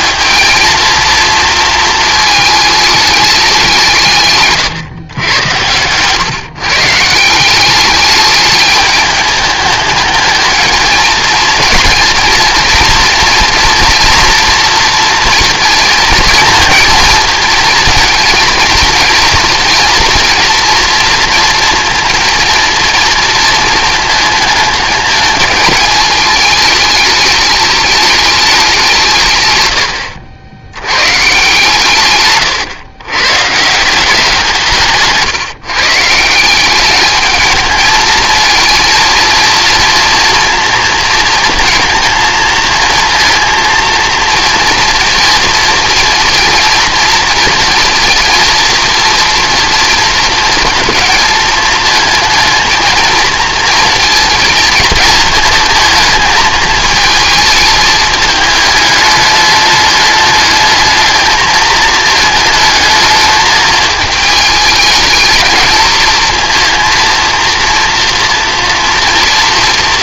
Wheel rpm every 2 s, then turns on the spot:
230, 220, 130, 150, 210, 220, 230, 230, 230, 230, 230, 230, 220, 220, 190, 80, 130, 170, 190, 230, 230, 220, 230, 230, 230, 230, 230, 230, 220, 210, 210, 220, 220, 230, 240.
none